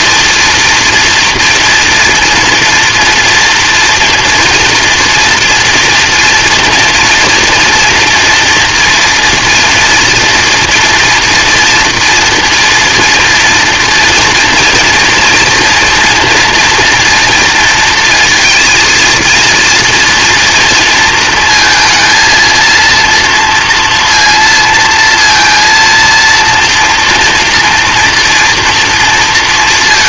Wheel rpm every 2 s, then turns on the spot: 240, 230, 230, 230, 230, 230, 230, 230, 240, 230, 230, 230, 230, 230, 230.
none